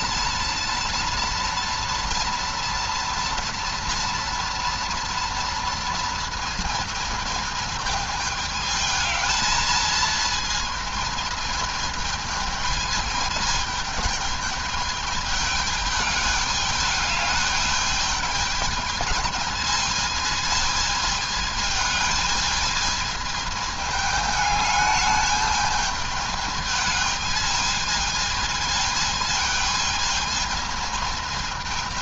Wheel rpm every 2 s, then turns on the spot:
230, 230, 230, 220, 220, 220, 220, 210, 210, 220, 220, 220, 210, 210, 220, 220.
none